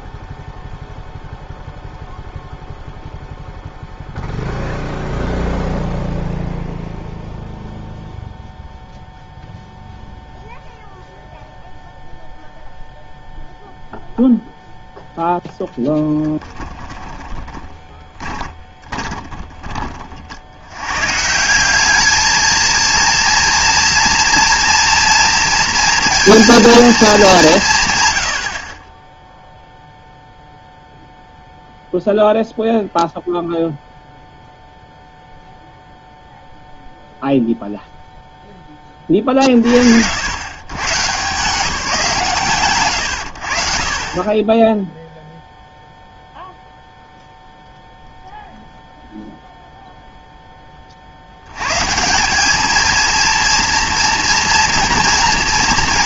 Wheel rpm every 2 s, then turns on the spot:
0, 0, 0, 0, 0, 0, 0, 0, 10, 20, 100, 230, 230, 230, 40, 0, 0, 0, 0, 10, 140, 130, 10, 0, 0, 30, 220, 230.
16-20